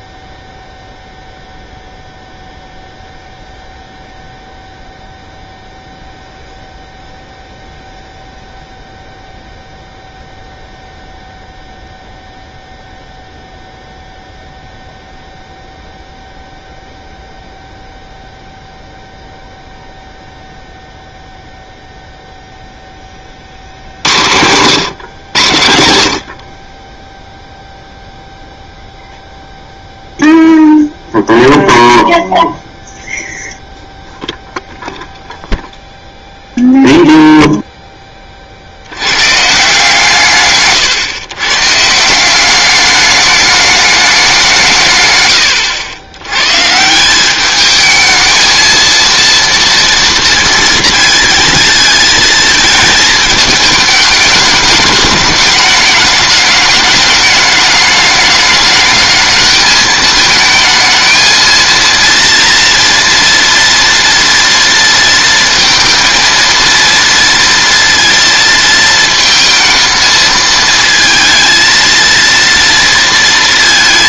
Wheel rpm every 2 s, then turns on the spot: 0, 0, 0, 0, 0, 0, 0, 0, 0, 0, 0, 0, 110, 40, 0, 0, 0, 0, 0, 50, 130, 190, 190, 120, 220, 230, 220, 210, 210, 210, 220, 230, 230, 230, 230, 220, 230.
none